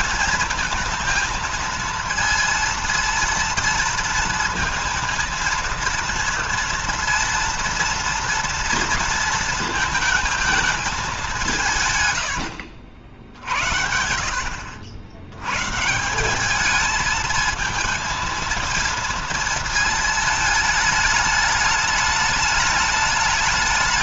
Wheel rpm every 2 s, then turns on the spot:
230, 230, 230, 230, 230, 220, 90, 70, 200, 230, 220, 210.
12-14